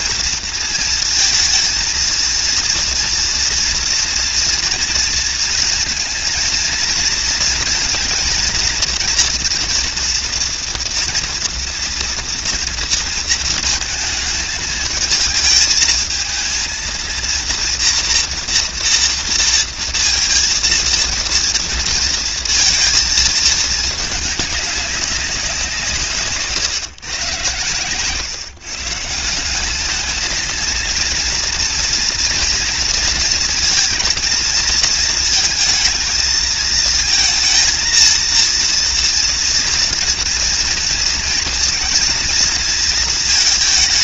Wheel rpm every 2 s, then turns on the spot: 230, 230, 230, 230, 240, 230, 230, 220, 230, 230, 230, 230, 200, 130, 150, 230, 230, 230, 230, 230, 230, 230.
none